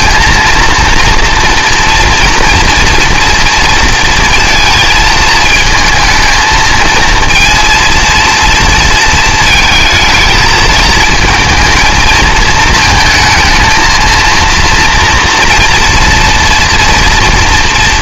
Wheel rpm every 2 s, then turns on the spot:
230, 230, 230, 230, 230, 230, 220, 230, 240.
none